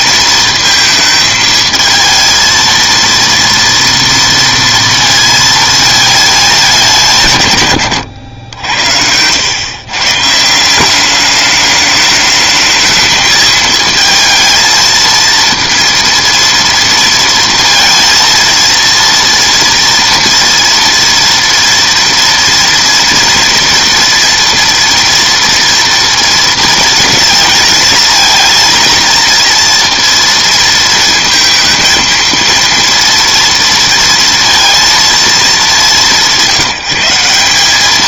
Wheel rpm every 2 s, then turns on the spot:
220, 230, 230, 200, 80, 170, 220, 220, 230, 230, 230, 230, 230, 230, 230, 230, 230, 230, 180.
none